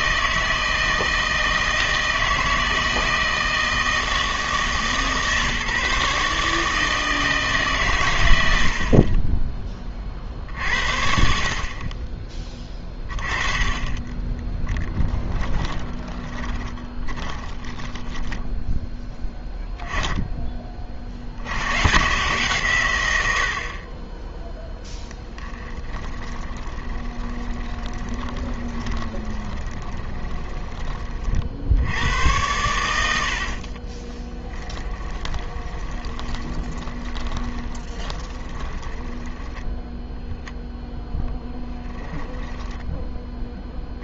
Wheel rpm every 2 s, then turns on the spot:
160, 160, 160, 150, 80, 60, 20, 20, 30, 10, 20, 130, 0, 20, 20, 20, 100, 10, 20, 20, 10, 10.
14-20 26-32 34-40 42-44